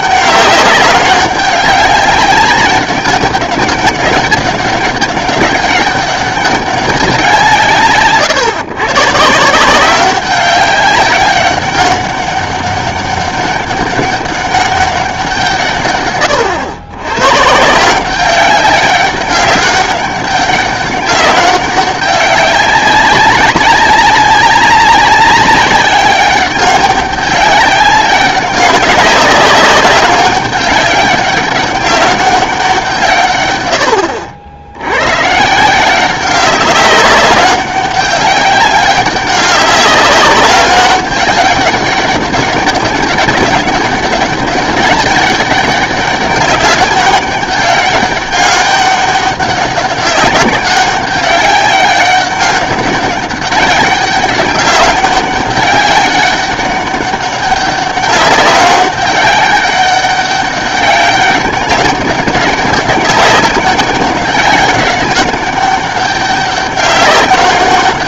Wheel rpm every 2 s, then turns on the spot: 200, 200, 200, 200, 130, 190, 200, 200, 110, 200, 190, 190, 190, 190, 190, 200, 180, 90, 200, 200, 190, 200, 200, 200, 200, 200, 200, 200, 200, 190, 200, 200, 200, 200.
none